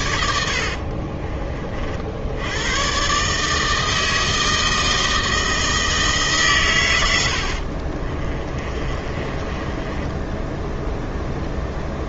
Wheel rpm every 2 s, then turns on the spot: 40, 120, 160, 100, 30, 0.
0-2 8-10